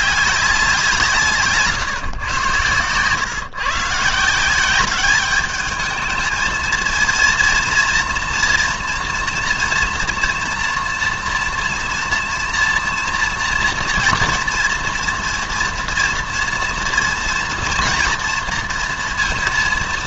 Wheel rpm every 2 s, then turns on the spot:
190, 110, 180, 220, 230, 240, 230, 230, 230, 230.
none